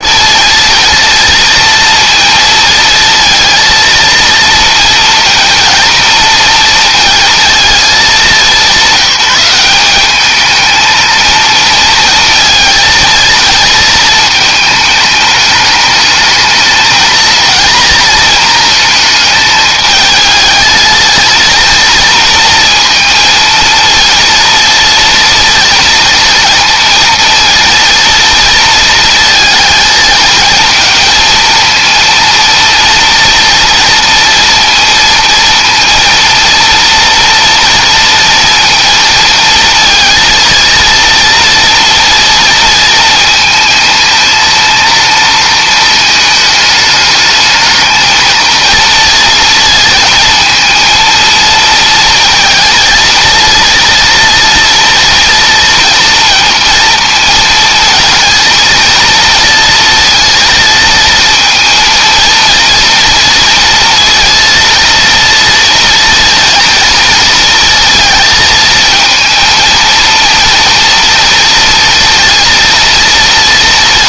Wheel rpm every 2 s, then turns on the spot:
230, 220, 230, 230, 190, 220, 230, 220, 230, 220, 230, 230, 230, 230, 230, 220, 230, 230, 230, 230, 230, 220, 230, 210, 230, 230, 230, 230, 230, 230, 230, 230, 230, 230, 230, 230, 230.
none